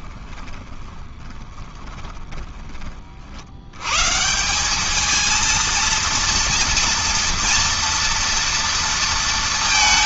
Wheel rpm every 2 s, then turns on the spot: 30, 30, 190, 230, 230.
0-2